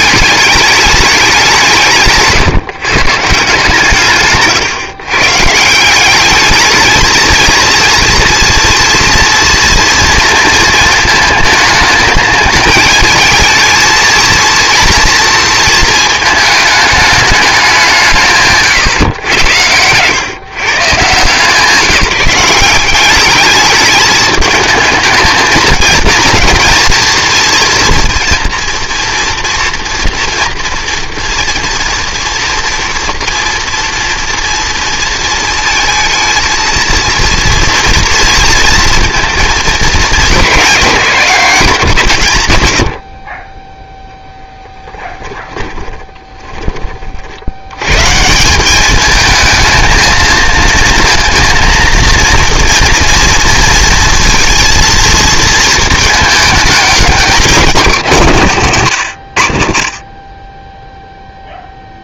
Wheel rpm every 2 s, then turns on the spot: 210, 150, 140, 220, 230, 230, 220, 230, 220, 140, 140, 180, 210, 230, 240, 230, 240, 230, 230, 230, 190, 30, 10, 20, 190, 220, 230, 230, 210, 160, 20.
18-20